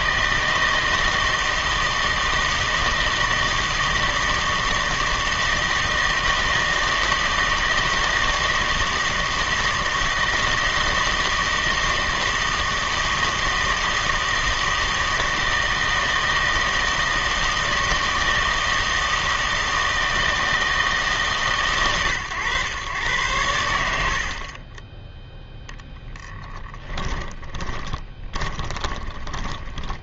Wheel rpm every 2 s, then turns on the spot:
160, 160, 160, 160, 160, 160, 160, 160, 160, 160, 160, 120, 20, 20, 30.
26-30